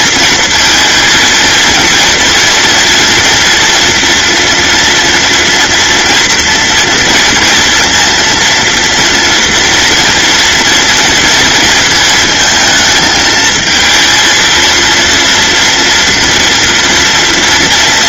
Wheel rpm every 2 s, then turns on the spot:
230, 230, 230, 230, 230, 230, 220, 230, 230.
none